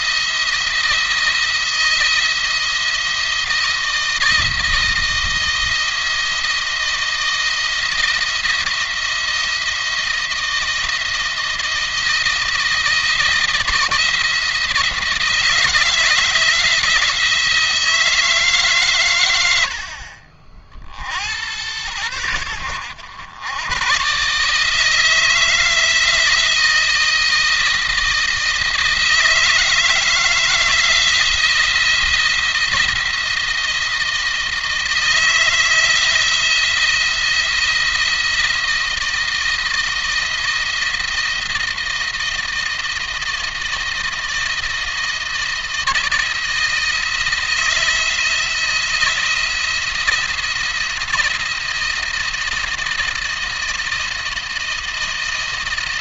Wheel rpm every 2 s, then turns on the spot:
160, 170, 160, 160, 170, 170, 170, 160, 160, 130, 60, 100, 150, 160, 160, 160, 170, 160, 170, 160, 160, 160, 160, 170, 170, 170, 170, 170.
none